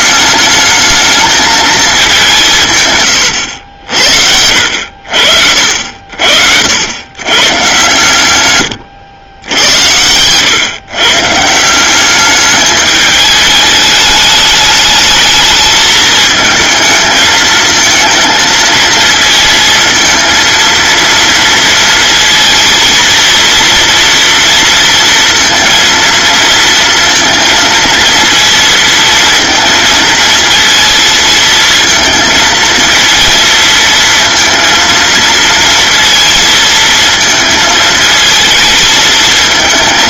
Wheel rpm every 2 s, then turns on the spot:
220, 120, 60, 120, 100, 130, 210, 210, 220, 230, 230, 230, 230, 230, 230, 230, 230, 230, 220, 220.
none